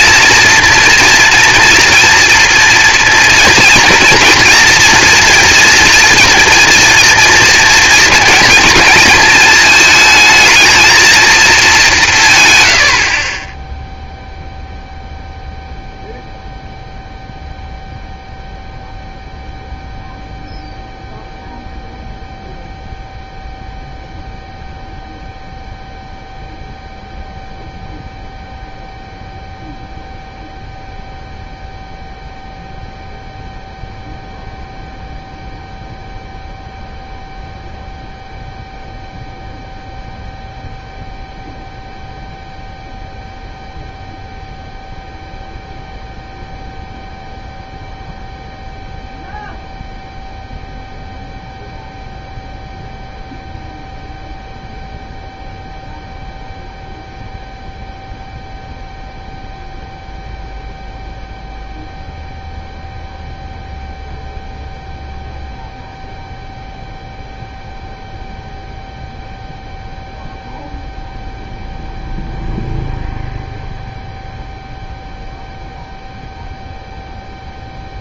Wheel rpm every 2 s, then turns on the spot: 240, 240, 230, 230, 240, 220, 110, 0, 0, 0, 0, 0, 0, 0, 0, 0, 0, 0, 0, 0, 0, 0, 0, 0, 0, 0, 0, 0, 0, 0, 0, 0, 0, 0, 0, 0, 0, 0, 0.
none